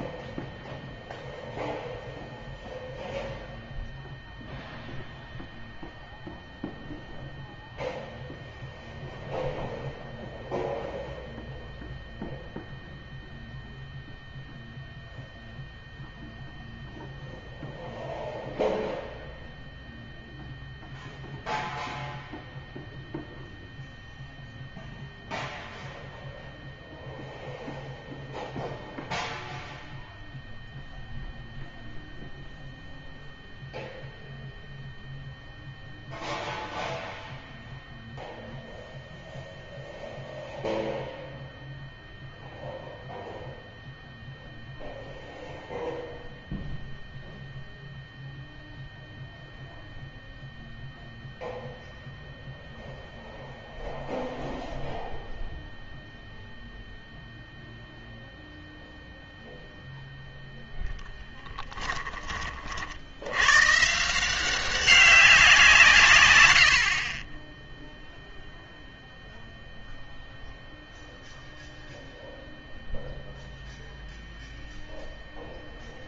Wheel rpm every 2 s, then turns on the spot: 0, 0, 0, 0, 0, 0, 0, 0, 0, 0, 0, 0, 0, 0, 0, 0, 0, 0, 0, 0, 0, 0, 0, 0, 0, 0, 0, 0, 0, 0, 0, 40, 190, 90, 0, 0, 0, 0.
none